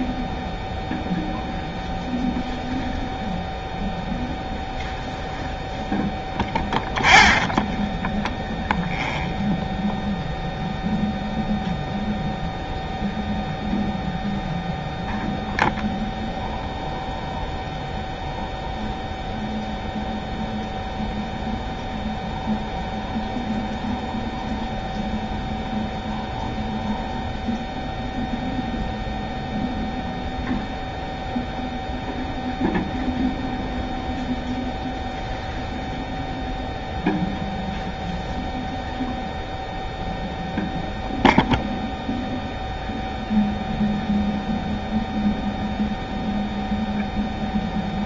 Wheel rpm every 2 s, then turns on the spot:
0, 0, 0, 0, 0, 0, 0, 0, 0, 0, 0, 0, 0, 0, 0, 0, 0, 0, 0, 0, 0, 0, 0, 0.
none